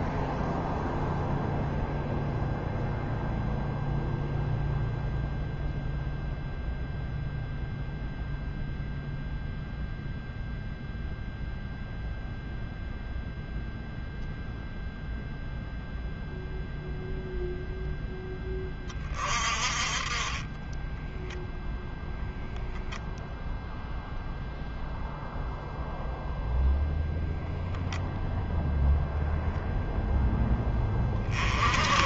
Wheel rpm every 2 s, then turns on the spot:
0, 0, 0, 0, 0, 0, 0, 0, 0, 10, 20, 0, 0, 0, 0, 10.
none